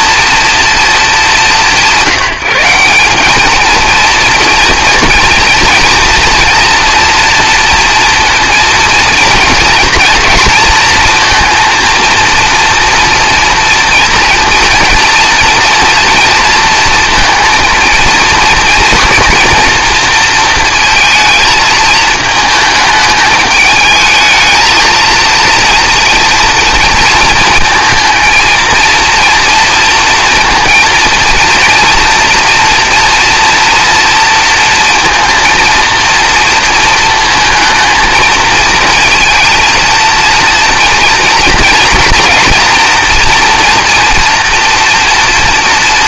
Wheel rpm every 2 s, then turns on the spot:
230, 180, 230, 230, 230, 230, 230, 240, 230, 230, 230, 220, 220, 230, 230, 230, 230, 230, 230, 220, 230, 230, 230.
none